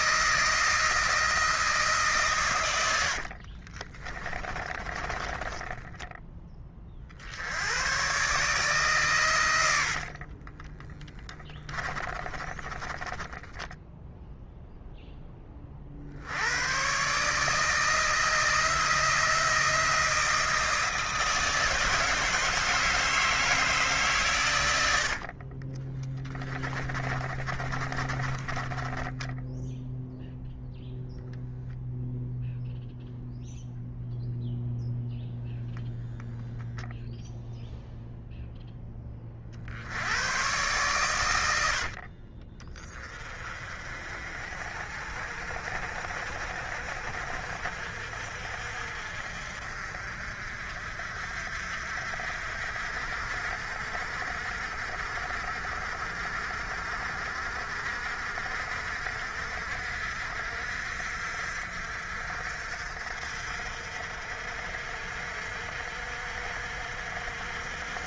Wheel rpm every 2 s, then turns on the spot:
160, 110, 30, 40, 150, 30, 10, 0, 110, 160, 160, 160, 100, 20, 20, 0, 0, 0, 0, 10, 120, 30, 50, 50, 60, 50, 60, 50, 50, 60, 60, 60, 60, 60.
2-6 10-14 26-30